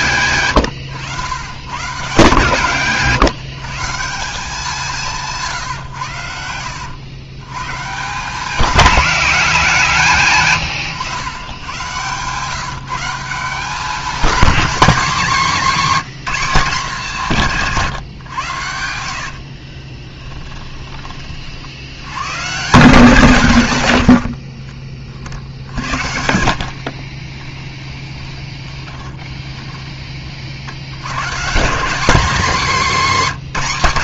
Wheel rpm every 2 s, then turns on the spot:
120, 140, 190, 90, 190, 130, 150, 230, 200, 80, 20, 150, 40, 60, 10, 80, 230.
18-20 24-30